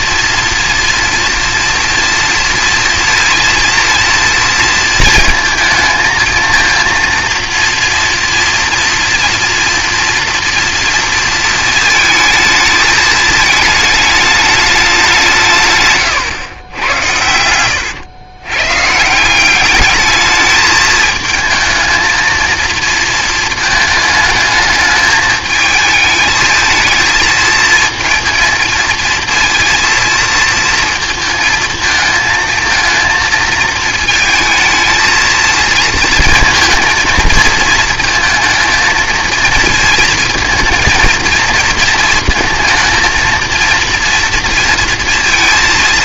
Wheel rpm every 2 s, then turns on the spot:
230, 230, 230, 230, 240, 230, 220, 210, 110, 120, 220, 230, 220, 220, 230, 230, 220, 230, 230, 230, 230, 230, 230.
none